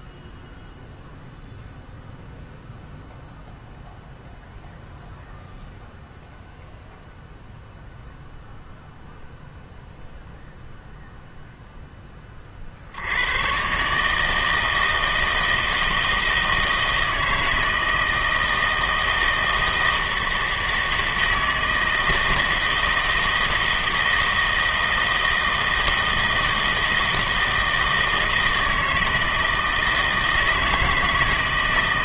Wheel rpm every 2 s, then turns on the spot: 0, 0, 0, 0, 0, 0, 50, 160, 160, 160, 160, 160, 160, 160, 160, 160.
none